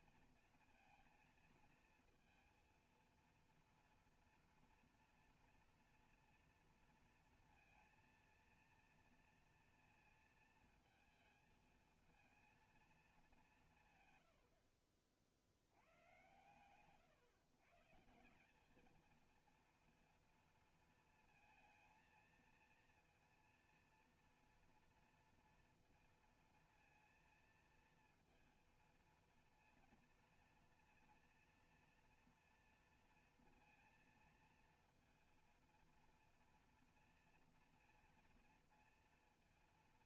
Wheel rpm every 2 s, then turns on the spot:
230, 230, 230, 230, 230, 230, 230, 80, 130, 190, 230, 230, 230, 230, 230, 230, 230, 230, 230, 230.
none